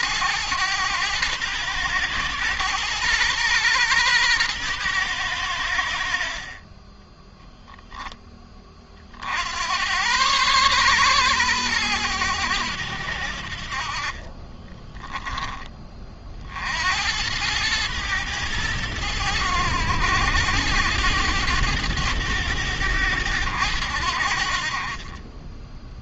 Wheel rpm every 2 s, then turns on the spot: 110, 120, 110, 30, 50, 120, 80, 20, 80, 100, 100, 100, 40.
6-8 14-16